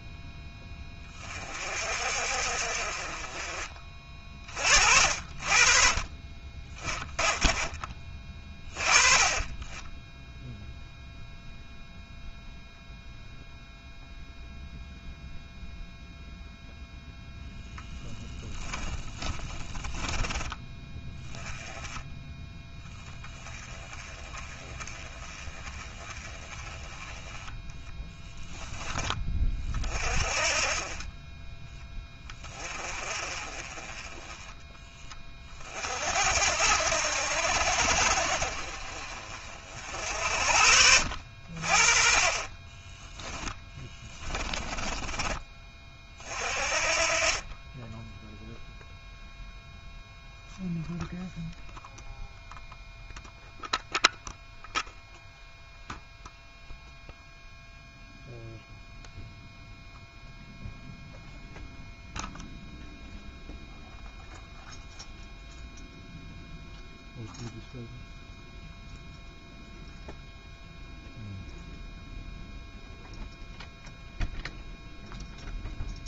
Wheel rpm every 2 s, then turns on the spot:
20, 40, 60, 20, 20, 0, 0, 0, 0, 10, 10, 20, 20, 20, 20, 30, 30, 20, 70, 40, 60, 20, 20, 40, 0, 0, 0, 0, 0, 0, 0, 0, 0, 0, 0, 0, 0, 0.
18-20 42-46